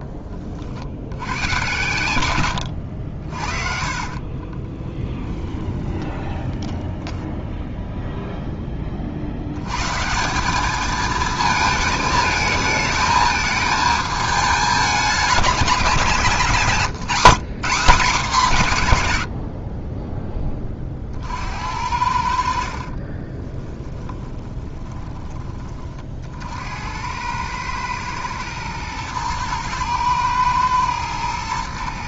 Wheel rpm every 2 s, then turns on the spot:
50, 90, 20, 10, 20, 200, 220, 210, 170, 200, 30, 60, 20, 70, 110, 110.
2-8 22-26